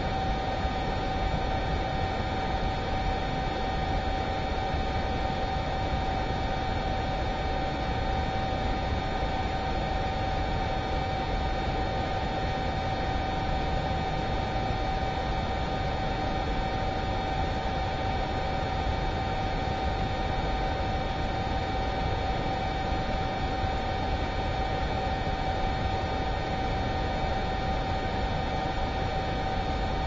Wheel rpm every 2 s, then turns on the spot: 0, 0, 0, 0, 0, 0, 0, 0, 0, 0, 0, 0, 0, 0, 0.
none